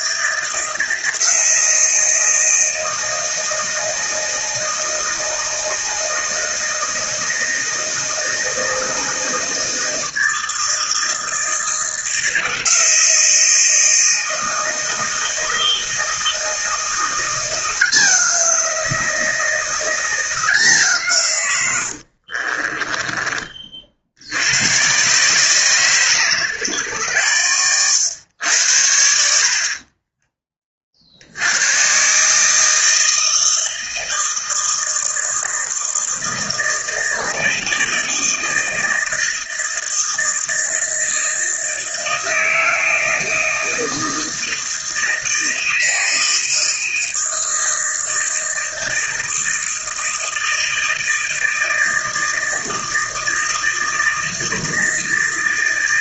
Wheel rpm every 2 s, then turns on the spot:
160, 160, 160, 160, 160, 160, 170, 160, 170, 170, 150, 20, 110, 110, 80, 40, 160, 160, 160, 160, 160, 160, 160, 160, 160, 160, 160, 160.
22-24